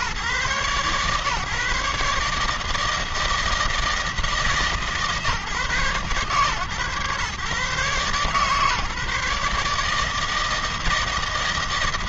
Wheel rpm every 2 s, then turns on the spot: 130, 150, 160, 130, 140, 160.
none